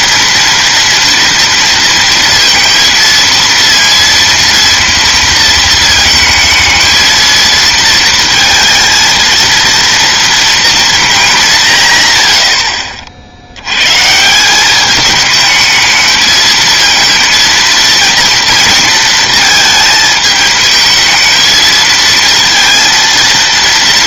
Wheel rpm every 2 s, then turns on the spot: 230, 230, 230, 220, 230, 230, 70, 190, 230, 230, 220, 230.
12-14